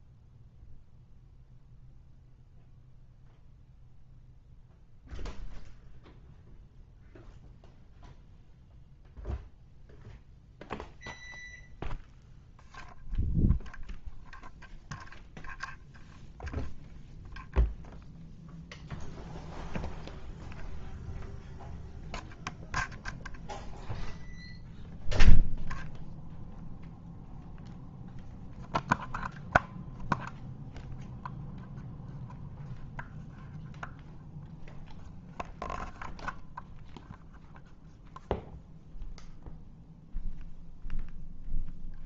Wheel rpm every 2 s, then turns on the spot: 0, 0, 0, 0, 0, 0, 0, 0, 0, 0, 0, 0, 0, 0, 0, 0, 0, 0, 0, 0, 0.
none